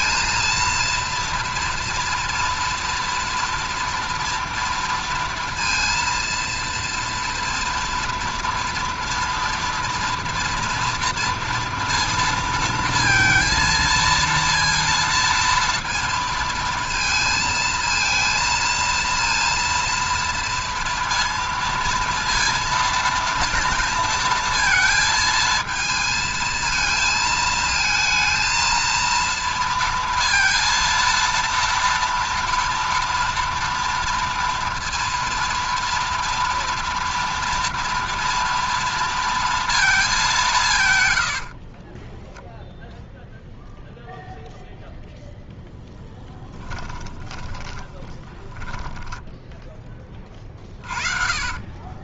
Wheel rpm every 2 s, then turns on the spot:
230, 230, 230, 230, 230, 230, 230, 230, 230, 230, 230, 230, 230, 220, 230, 230, 230, 230, 230, 230, 180, 0, 0, 10, 10, 30.
46-52